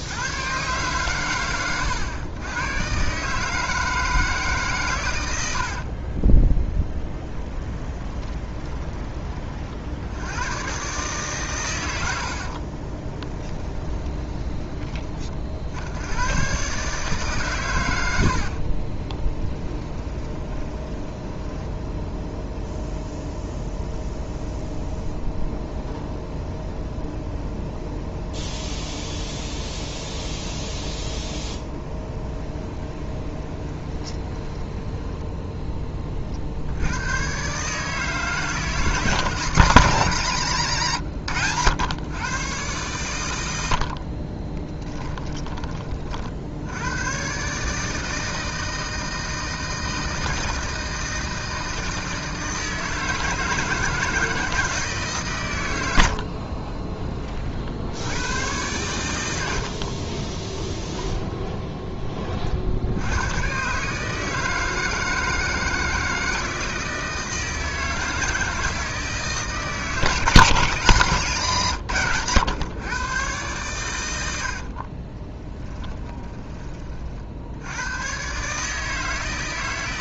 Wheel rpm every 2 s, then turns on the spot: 120, 120, 140, 10, 20, 120, 30, 30, 140, 30, 20, 0, 0, 0, 0, 0, 20, 10, 80, 170, 130, 110, 20, 90, 160, 160, 160, 150, 20, 100, 10, 80, 160, 160, 160, 150, 120, 50, 30, 150.
6-8 12-14 18-22 32-36 44-46 60-62 74-76